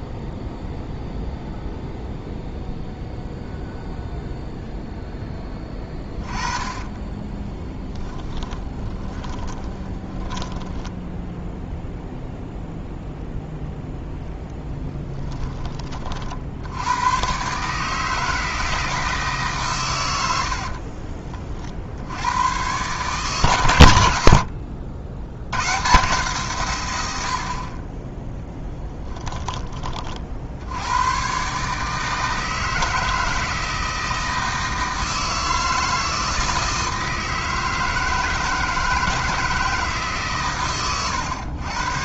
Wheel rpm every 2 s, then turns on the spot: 0, 0, 0, 40, 30, 10, 0, 10, 100, 160, 60, 120, 80, 120, 10, 90, 160, 160, 160, 160, 120.
6-12 20-22 28-30